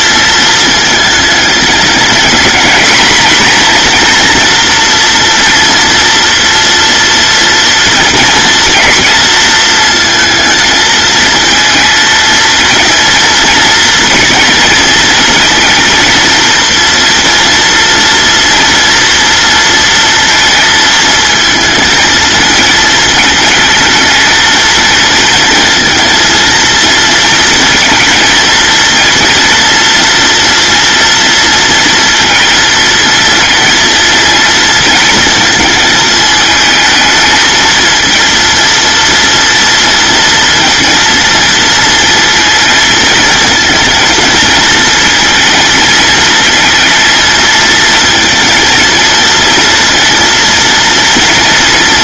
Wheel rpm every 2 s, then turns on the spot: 220, 230, 230, 230, 230, 220, 230, 230, 230, 230, 230, 220, 230, 230, 230, 230, 230, 230, 220, 230, 230, 230, 230, 230, 230, 230.
none